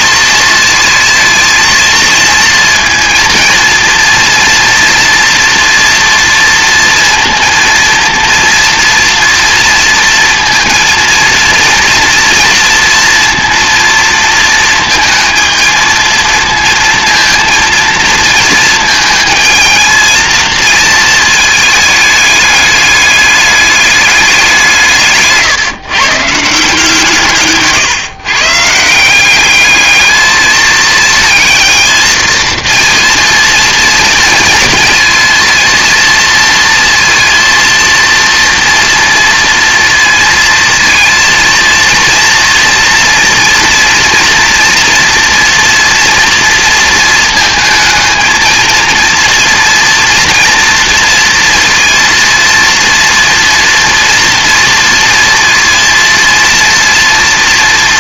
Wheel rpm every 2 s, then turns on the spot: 220, 230, 230, 230, 230, 230, 230, 230, 230, 230, 230, 210, 190, 160, 140, 210, 230, 230, 230, 230, 230, 230, 230, 230, 220, 230, 230, 230, 230.
none